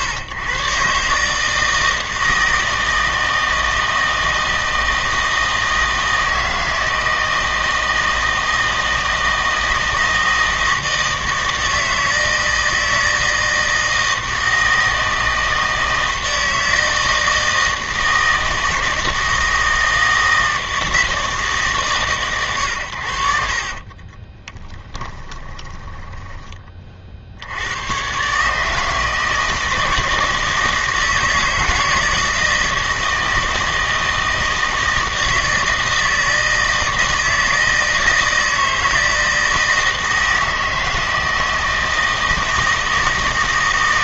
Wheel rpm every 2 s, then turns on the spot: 130, 160, 160, 160, 160, 160, 160, 160, 160, 160, 160, 110, 20, 20, 150, 160, 160, 160, 160, 160, 160, 160.
24-26